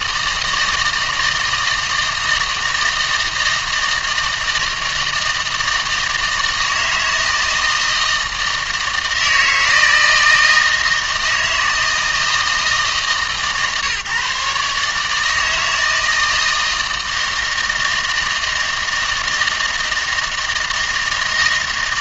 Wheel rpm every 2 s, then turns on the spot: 160, 160, 160, 160, 160, 160, 160, 140, 160, 160, 160.
none